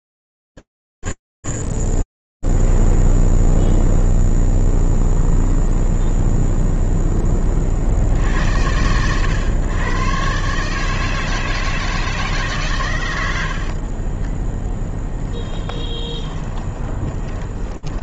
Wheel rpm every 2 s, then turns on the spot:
20, 0, 0, 10, 110, 160, 100, 10, 20.
14-18